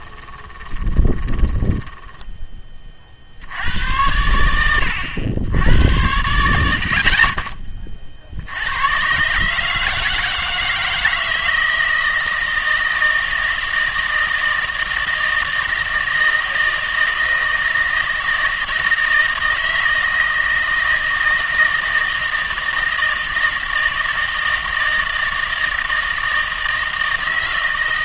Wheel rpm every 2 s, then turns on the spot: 20, 20, 90, 80, 80, 160, 160, 160, 160, 160, 160, 160, 160, 160.
0-2